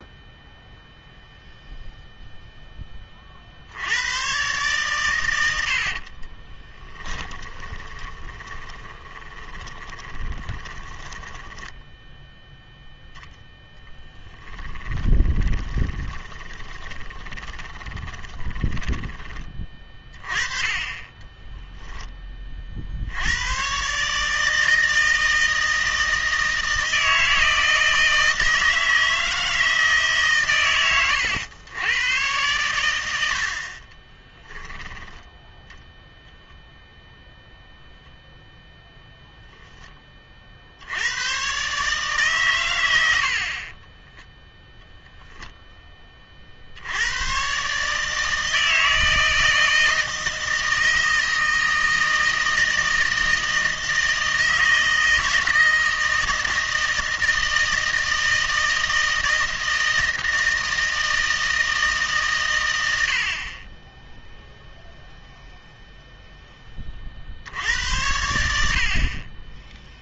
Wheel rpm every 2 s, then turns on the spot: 0, 10, 120, 10, 20, 20, 0, 20, 20, 20, 20, 50, 160, 160, 160, 110, 130, 10, 0, 0, 60, 110, 0, 70, 160, 160, 160, 160, 160, 160, 160, 90, 0, 10, 70.
6-12 14-22